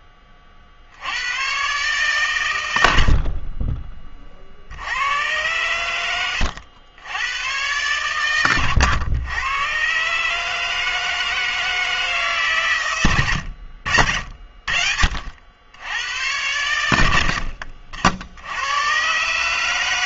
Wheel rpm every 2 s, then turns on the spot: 50, 130, 60, 80, 110, 150, 130, 60, 100, 80.
none